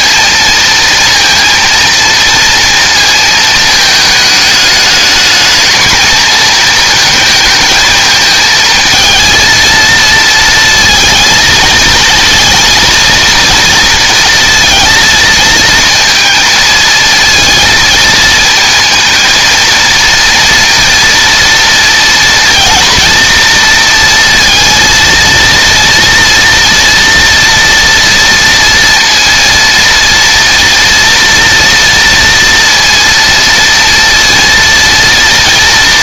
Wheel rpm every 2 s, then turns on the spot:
230, 220, 220, 220, 230, 220, 230, 230, 230, 230, 230, 230, 230, 230, 230, 230, 230, 230.
none